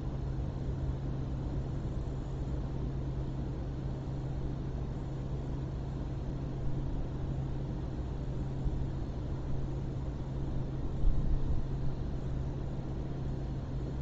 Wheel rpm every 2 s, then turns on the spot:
0, 0, 0, 0, 0, 0, 0.
none